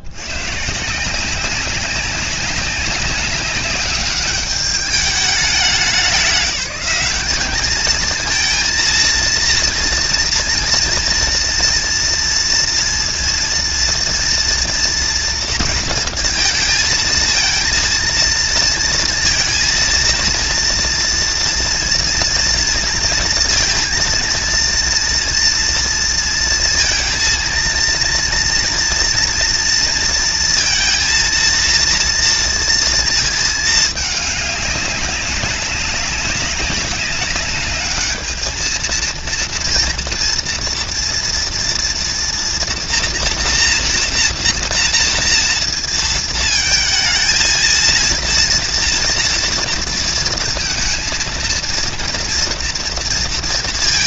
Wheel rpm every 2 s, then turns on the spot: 170, 190, 210, 190, 230, 240, 230, 230, 220, 230, 230, 230, 230, 230, 230, 230, 230, 200, 190, 230, 230, 230, 230, 230, 230, 230, 230.
none